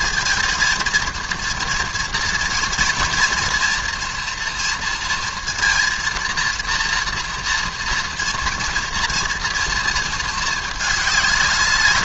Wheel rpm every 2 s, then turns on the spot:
230, 230, 230, 230, 240, 210.
none